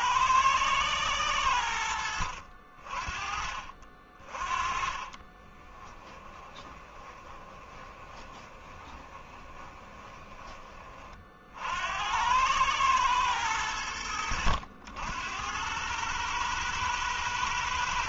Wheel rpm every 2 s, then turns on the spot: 110, 40, 20, 20, 20, 30, 110, 80, 100.
4-10